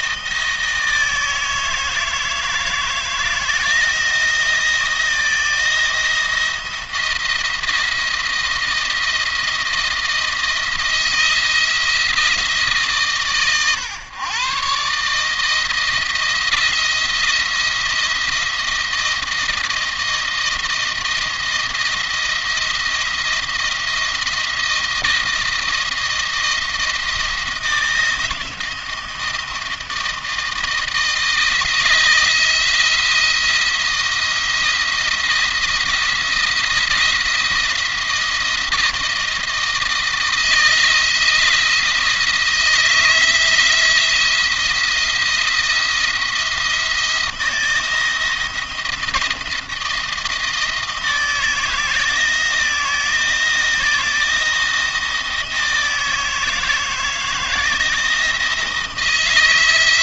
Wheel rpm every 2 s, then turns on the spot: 160, 160, 160, 170, 170, 170, 150, 130, 160, 170, 160, 170, 170, 170, 170, 160, 160, 170, 170, 170, 160, 160, 170, 170, 170, 160, 160, 160, 160, 160.
none